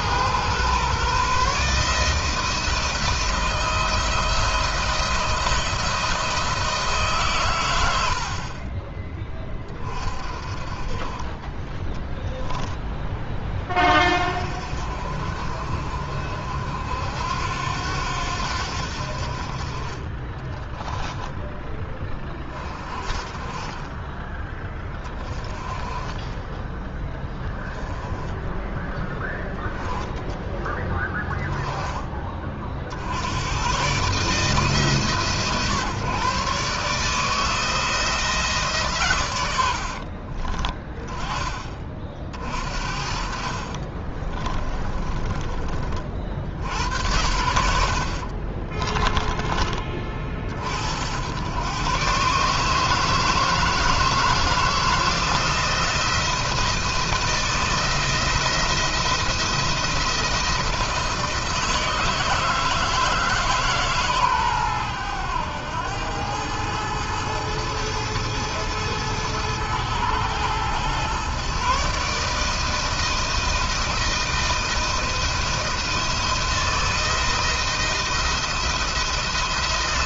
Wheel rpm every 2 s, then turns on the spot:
130, 160, 170, 150, 30, 30, 10, 50, 70, 70, 10, 30, 20, 10, 10, 20, 70, 150, 150, 140, 20, 60, 30, 80, 20, 80, 150, 170, 160, 170, 160, 160, 110, 110, 110, 120, 160, 160, 160, 160.
20-22 44-46 48-50